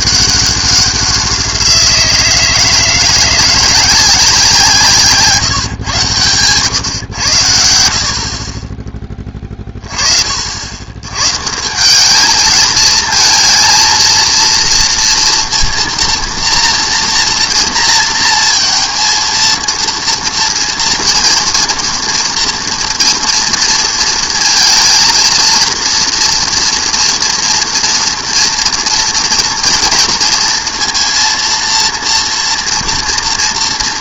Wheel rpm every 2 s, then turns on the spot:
190, 160, 170, 120, 30, 80, 220, 230, 230, 230, 230, 230, 230, 230, 240, 230, 230.
none